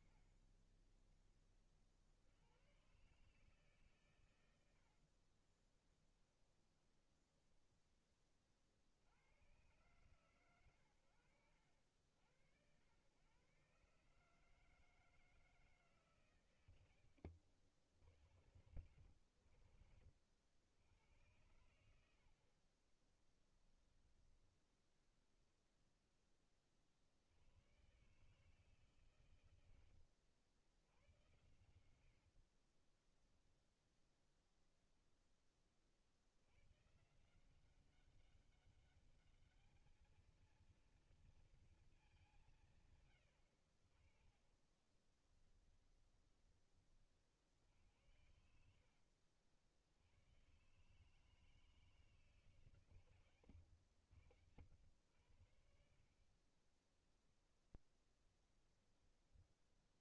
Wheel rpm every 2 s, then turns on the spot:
30, 130, 60, 10, 60, 100, 100, 160, 110, 90, 90, 30, 0, 60, 140, 100, 20, 0, 140, 200, 230, 130, 20, 40, 80, 150, 140, 80, 20, 20.
4-8 16-18 22-24 32-34 44-46 56-60